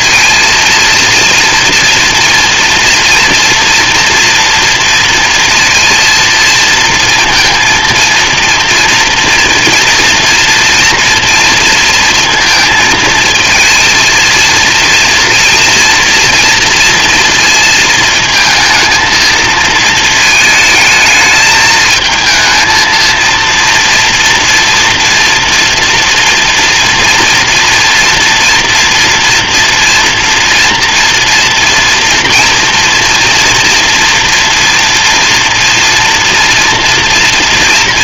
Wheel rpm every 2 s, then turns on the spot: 230, 230, 230, 230, 230, 230, 220, 230, 230, 220, 220, 230, 230, 230, 230, 230, 240, 230, 240.
none